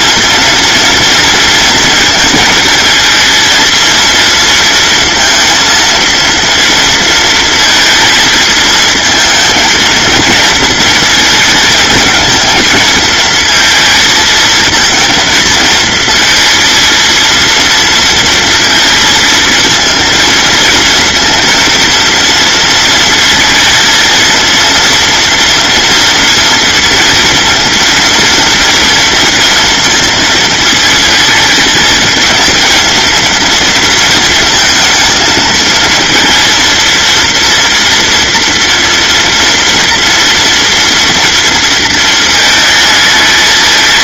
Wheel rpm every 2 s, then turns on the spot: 230, 220, 230, 230, 230, 230, 220, 220, 230, 230, 230, 230, 230, 230, 230, 230, 230, 220, 230, 230, 230, 220.
none